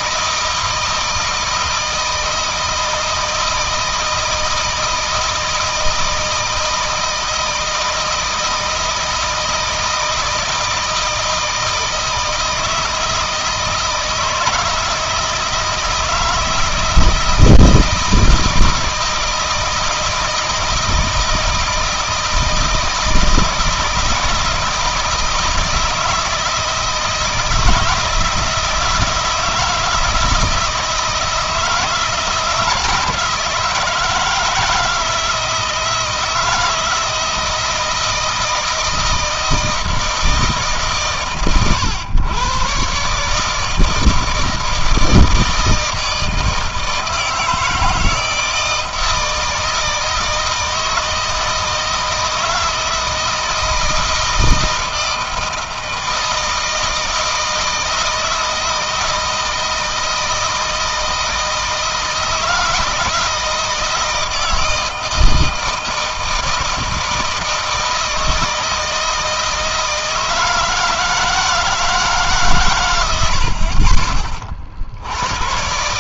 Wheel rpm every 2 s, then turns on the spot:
160, 160, 160, 160, 160, 160, 160, 160, 160, 160, 160, 160, 160, 160, 160, 160, 170, 160, 160, 160, 150, 140, 160, 160, 160, 160, 160, 160, 160, 160, 160, 160, 160, 160, 160, 160, 110, 70.
none